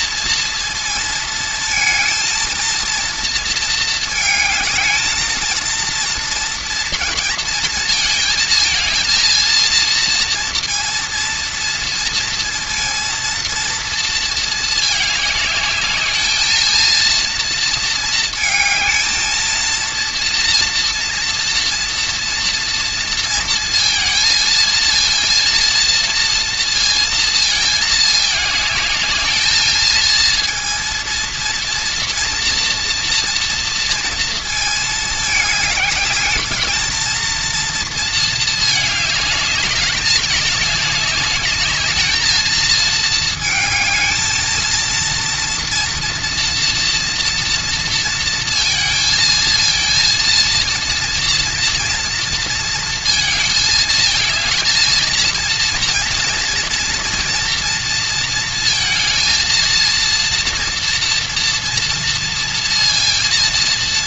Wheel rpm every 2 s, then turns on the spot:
230, 230, 220, 230, 220, 230, 230, 220, 220, 220, 230, 230, 230, 230, 210, 230, 230, 220, 220, 220, 210, 230, 230, 240, 230, 230, 230, 230, 230, 230, 230, 230.
none